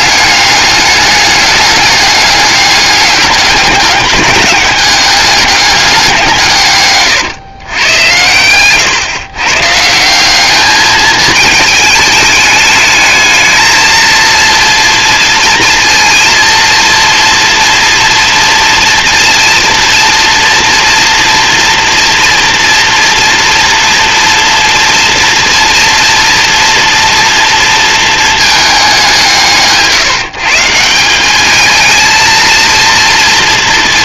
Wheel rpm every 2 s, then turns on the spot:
200, 200, 210, 120, 120, 220, 220, 230, 230, 230, 230, 230, 230, 230, 190, 180, 230.
none